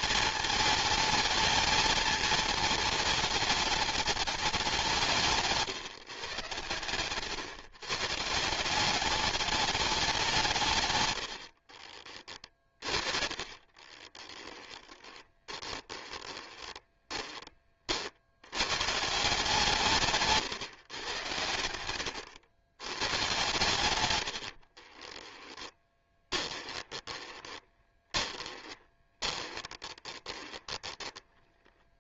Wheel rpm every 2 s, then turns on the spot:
220, 220, 200, 120, 190, 140, 40, 10, 20, 120, 130, 100, 40, 20, 20, 20.
12-18 24-32